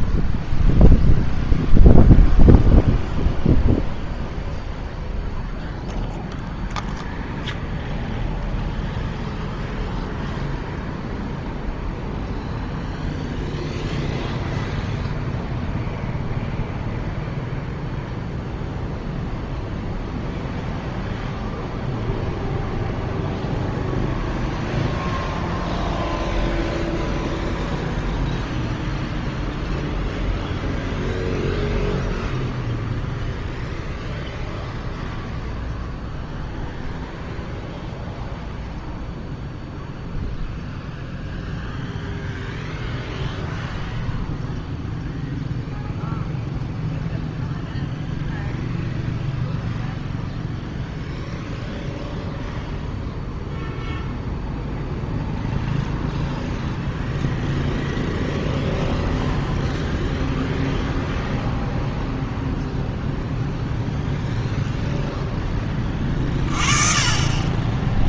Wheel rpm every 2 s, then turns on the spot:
0, 0, 0, 0, 0, 0, 0, 0, 0, 0, 0, 0, 0, 0, 0, 0, 0, 0, 0, 0, 0, 0, 0, 0, 0, 0, 0, 0, 0, 0, 0, 0, 0, 30.
none